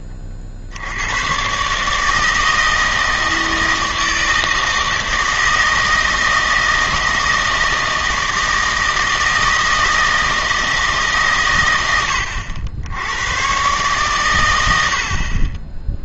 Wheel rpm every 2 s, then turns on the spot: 70, 160, 160, 160, 160, 160, 80, 80.
none